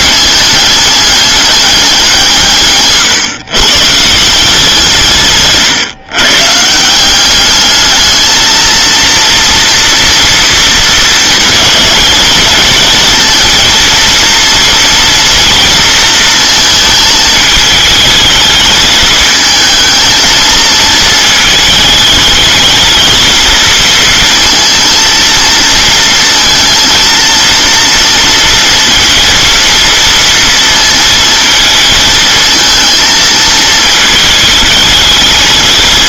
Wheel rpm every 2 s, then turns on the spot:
210, 160, 160, 130, 220, 230, 220, 230, 230, 220, 220, 210, 230, 230, 230, 230, 220, 220.
none